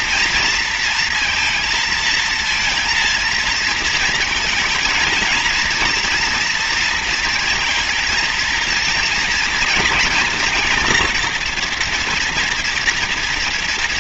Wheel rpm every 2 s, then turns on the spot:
230, 230, 220, 230, 230, 230, 240.
none